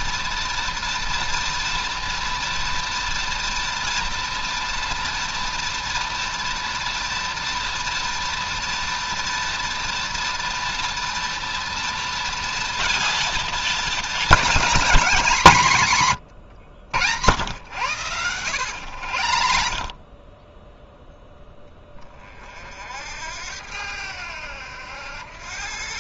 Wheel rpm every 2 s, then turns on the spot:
230, 240, 240, 230, 230, 230, 230, 210, 100, 100, 0, 60, 90.
18-20